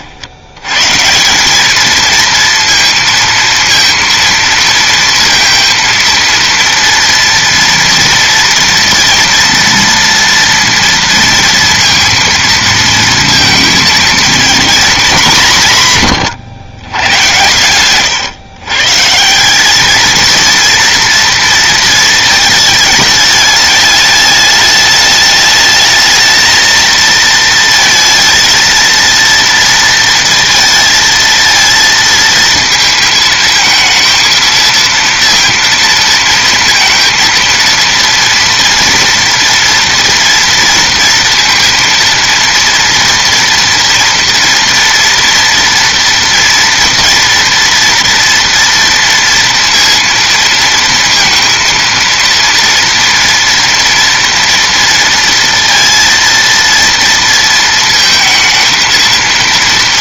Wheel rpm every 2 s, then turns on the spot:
80, 230, 230, 230, 230, 230, 230, 230, 130, 120, 230, 220, 210, 220, 220, 230, 230, 230, 230, 230, 230, 230, 230, 230, 230, 230, 230, 230, 230, 220.
none